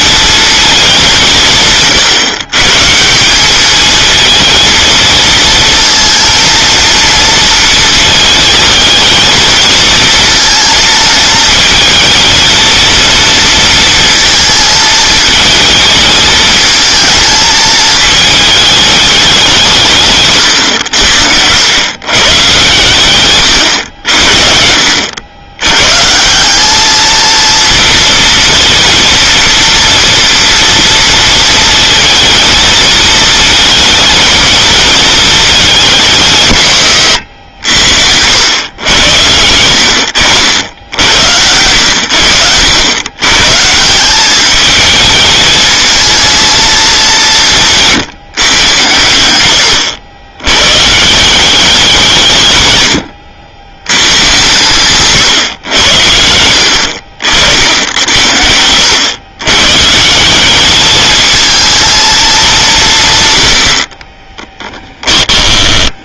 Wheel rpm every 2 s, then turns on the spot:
220, 140, 220, 230, 220, 220, 230, 220, 220, 210, 110, 120, 60, 200, 230, 230, 220, 230, 120, 100, 80, 90, 210, 220, 120, 120, 120, 130, 70, 80, 200, 180, 20.
64-66